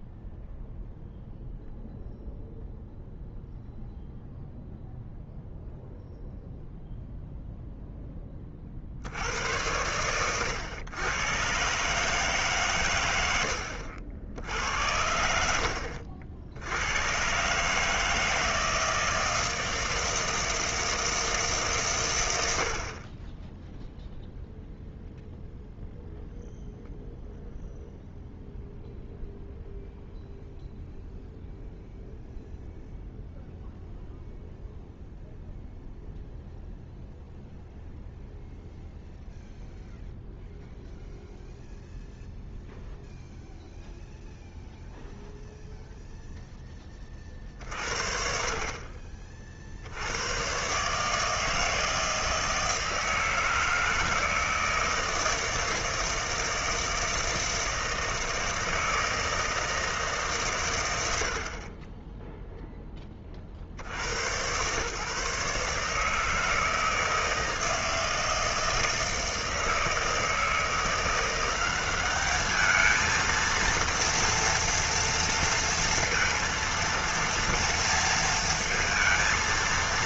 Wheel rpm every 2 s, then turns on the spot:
0, 0, 0, 0, 40, 110, 130, 80, 80, 160, 160, 70, 0, 0, 0, 0, 0, 0, 0, 0, 0, 0, 0, 10, 40, 120, 160, 160, 160, 160, 120, 0, 120, 160, 160, 170, 220, 230, 230, 230.
none